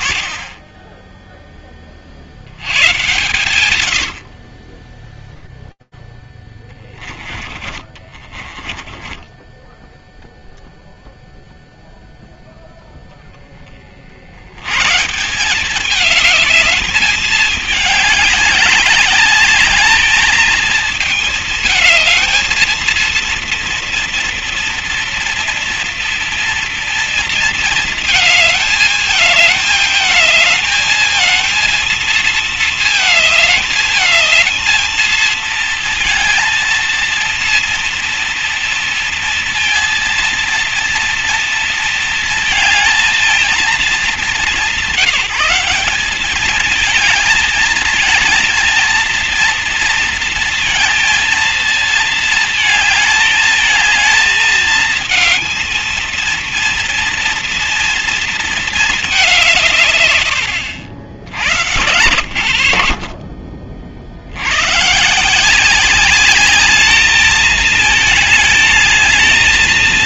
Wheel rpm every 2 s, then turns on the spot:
30, 110, 10, 20, 20, 0, 20, 190, 210, 200, 220, 230, 230, 230, 220, 230, 220, 230, 230, 230, 230, 220, 190, 220, 230, 230, 220, 220, 240, 170, 90, 40, 160, 210, 220.
6-10 60-64